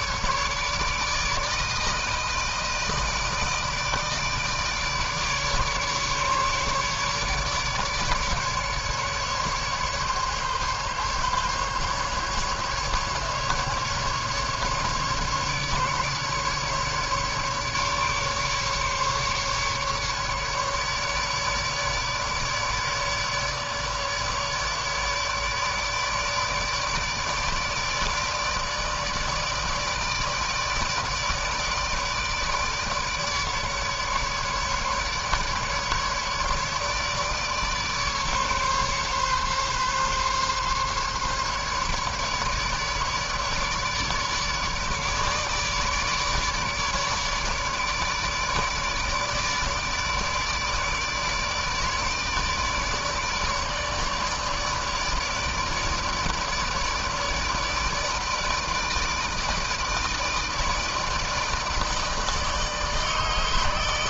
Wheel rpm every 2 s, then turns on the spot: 150, 160, 150, 150, 150, 140, 150, 150, 150, 140, 150, 150, 150, 150, 150, 160, 150, 150, 150, 140, 140, 150, 150, 150, 150, 150, 150, 150, 150, 160, 160, 160.
none